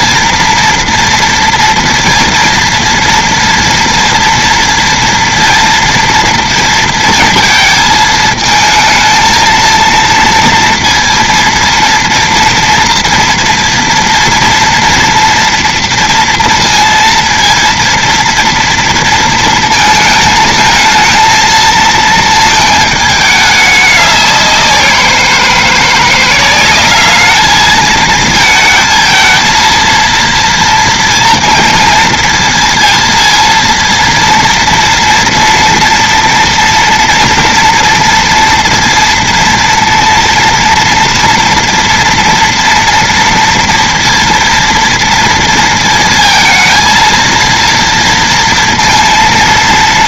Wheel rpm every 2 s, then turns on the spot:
230, 230, 230, 230, 220, 230, 230, 230, 230, 230, 220, 220, 190, 180, 220, 230, 230, 230, 230, 230, 230, 230, 230, 230, 230.
none